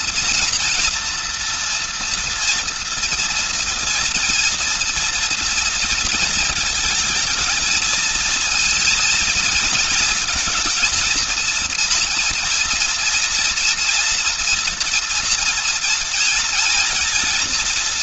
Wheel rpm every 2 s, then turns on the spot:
240, 240, 240, 230, 230, 230, 230, 230, 230.
none